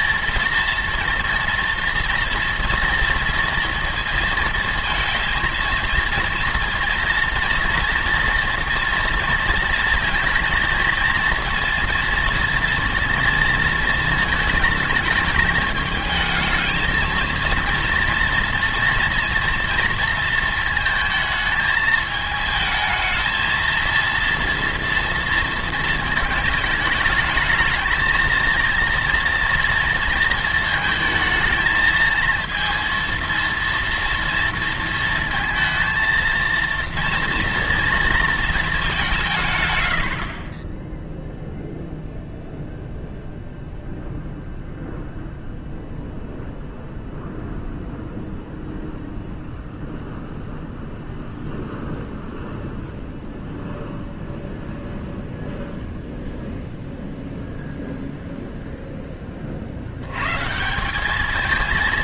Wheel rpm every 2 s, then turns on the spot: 230, 230, 230, 230, 230, 230, 230, 220, 220, 230, 220, 220, 230, 220, 230, 220, 230, 230, 230, 220, 30, 0, 0, 0, 0, 0, 0, 0, 0, 0, 170.
none